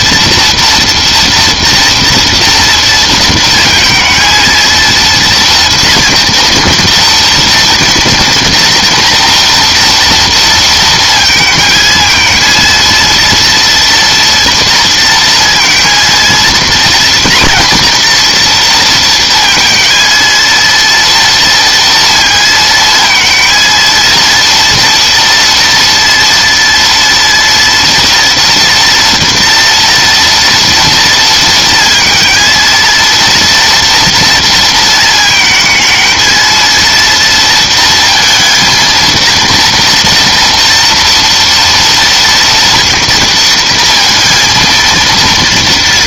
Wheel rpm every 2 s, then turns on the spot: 230, 230, 230, 230, 230, 230, 230, 230, 240, 230, 230, 230, 230, 240, 230, 230, 230, 220, 230, 230, 240, 230, 230.
none